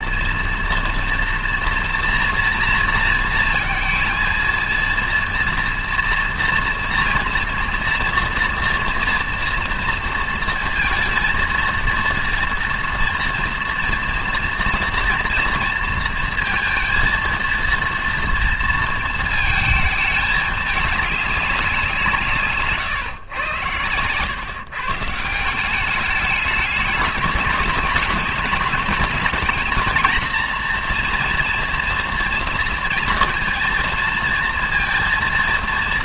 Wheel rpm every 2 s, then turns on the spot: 230, 230, 230, 230, 230, 230, 230, 230, 230, 230, 210, 150, 130, 210, 210, 230, 230, 230.
none